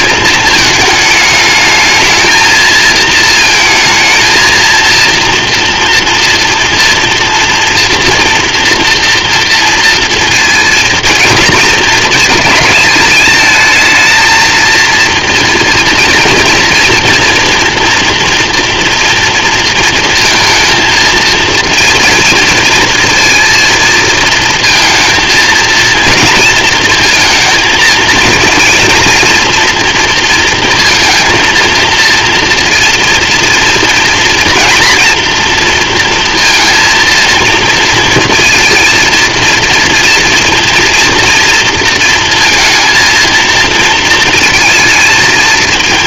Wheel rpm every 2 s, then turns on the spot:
210, 220, 230, 230, 230, 220, 210, 230, 230, 230, 230, 230, 230, 230, 230, 230, 230, 240, 230, 230, 230, 230, 230.
none